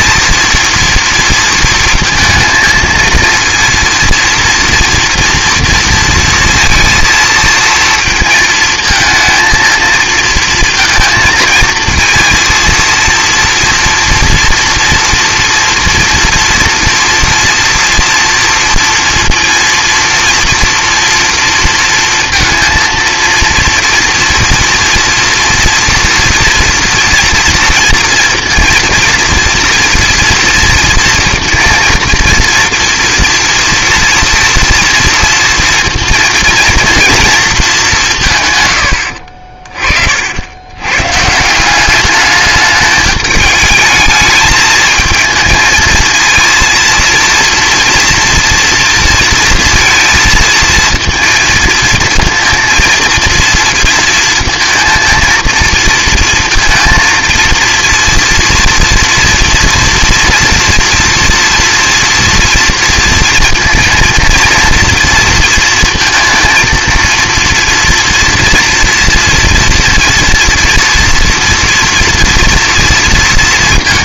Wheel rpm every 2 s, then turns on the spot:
230, 230, 230, 230, 220, 230, 230, 240, 230, 230, 230, 230, 240, 230, 230, 230, 240, 230, 230, 120, 90, 210, 220, 230, 230, 230, 230, 230, 230, 230, 240, 230, 240, 230, 230, 230, 230.
none